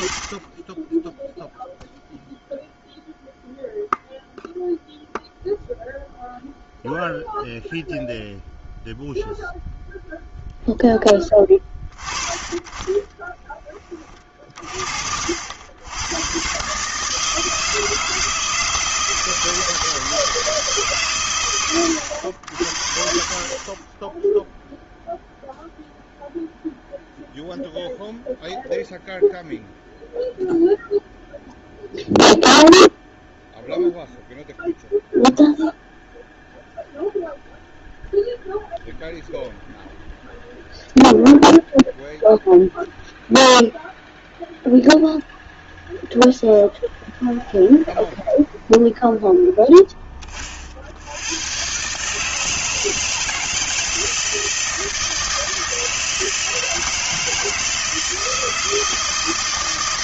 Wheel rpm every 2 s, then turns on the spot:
20, 0, 0, 0, 0, 0, 20, 50, 120, 160, 160, 80, 0, 0, 0, 0, 0, 0, 0, 0, 0, 0, 0, 0, 0, 30, 160, 160, 160, 160.
none